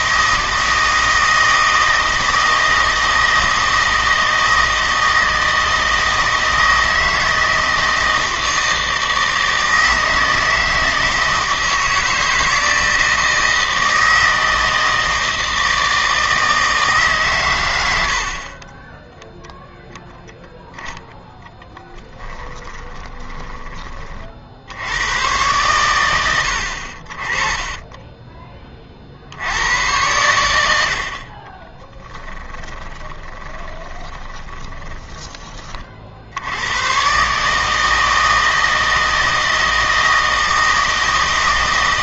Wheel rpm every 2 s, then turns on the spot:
160, 160, 160, 160, 160, 160, 160, 160, 160, 20, 10, 10, 80, 70, 20, 80, 20, 30, 100, 160, 160.
22-24 32-36